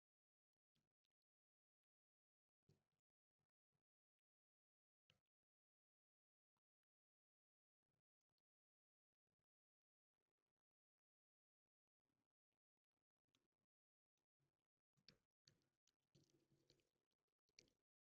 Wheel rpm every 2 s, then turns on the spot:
0, 0, 0, 0, 0, 0, 0, 0, 0.
none